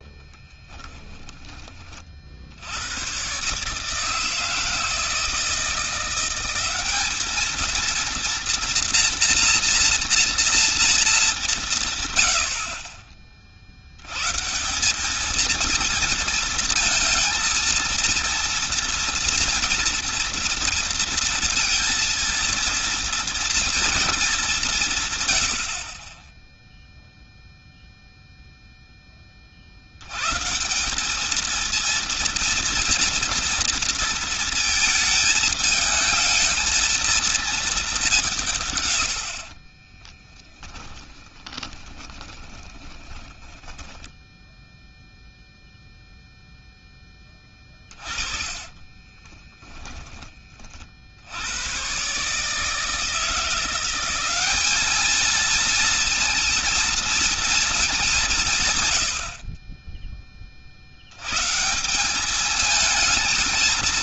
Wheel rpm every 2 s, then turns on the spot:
10, 70, 160, 190, 240, 230, 60, 160, 230, 230, 230, 230, 180, 0, 0, 150, 230, 220, 220, 150, 10, 10, 0, 0, 30, 40, 150, 200, 230, 140, 50, 220.
0-2 40-44 48-50